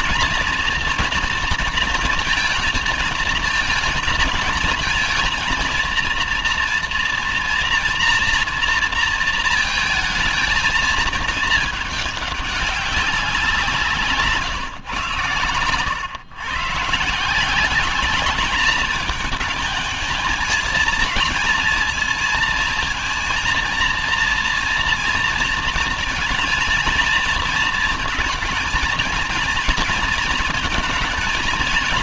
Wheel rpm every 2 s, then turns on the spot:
240, 220, 230, 230, 230, 220, 190, 120, 140, 220, 220, 230, 230, 230, 230, 230.
none